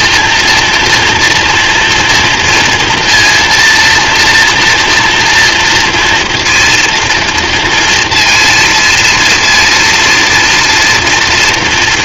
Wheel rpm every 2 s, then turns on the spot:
230, 230, 230, 240, 230, 230.
none